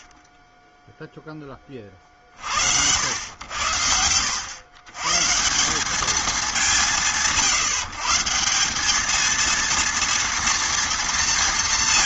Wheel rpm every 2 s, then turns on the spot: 0, 80, 120, 180, 200, 230.
none